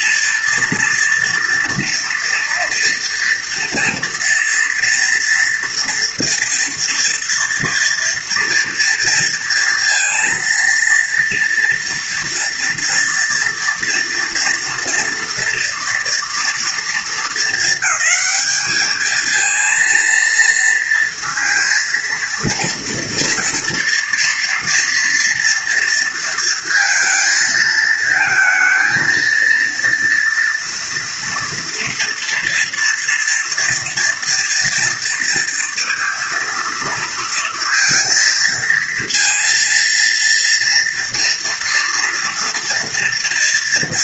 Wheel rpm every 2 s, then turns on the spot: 230, 240, 230, 230, 230, 230, 230, 230, 220, 210, 230, 230, 230, 230, 220, 230, 230, 230, 230, 230, 230, 230.
none